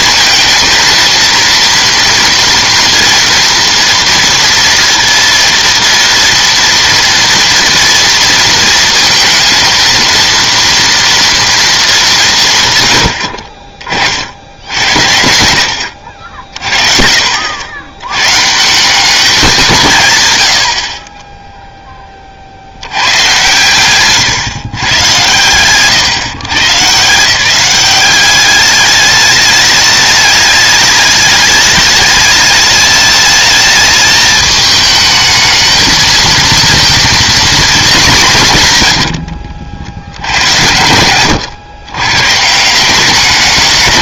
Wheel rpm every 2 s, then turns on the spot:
230, 230, 230, 240, 230, 230, 120, 70, 50, 160, 70, 80, 120, 140, 200, 210, 210, 220, 230, 140, 110, 180.
none